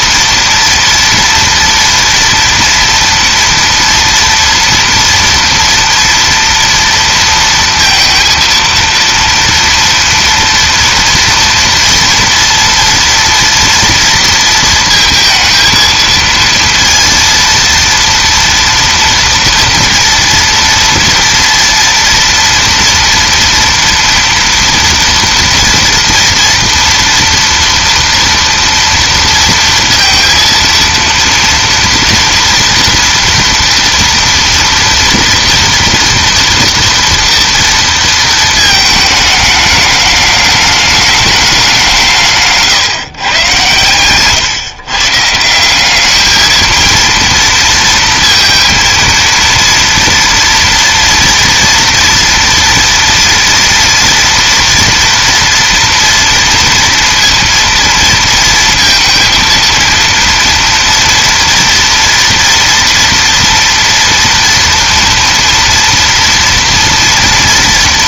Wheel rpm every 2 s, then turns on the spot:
230, 230, 230, 230, 230, 230, 230, 230, 230, 230, 230, 230, 230, 230, 230, 230, 230, 230, 230, 220, 210, 150, 130, 220, 230, 230, 230, 240, 230, 230, 230, 230, 230, 230.
none